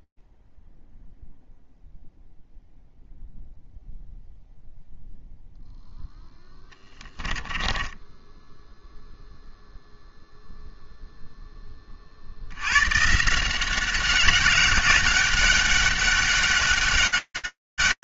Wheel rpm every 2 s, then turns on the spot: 0, 0, 0, 10, 0, 0, 120, 190, 200.
6-8